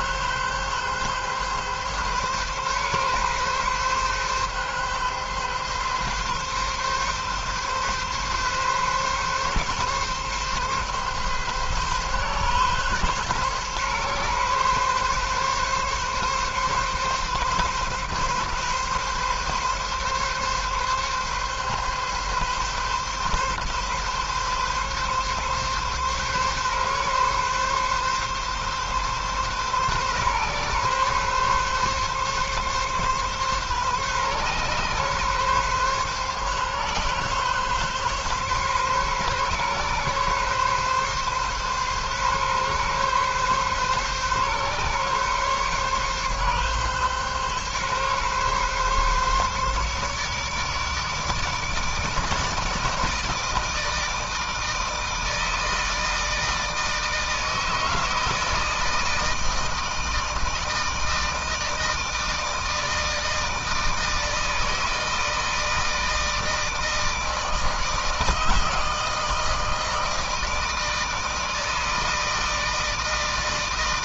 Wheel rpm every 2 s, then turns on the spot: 140, 140, 140, 140, 140, 140, 130, 130, 130, 140, 140, 130, 140, 140, 140, 140, 140, 140, 140, 140, 140, 130, 140, 140, 140, 150, 160, 160, 160, 160, 160, 160, 160, 160, 160, 160, 160.
none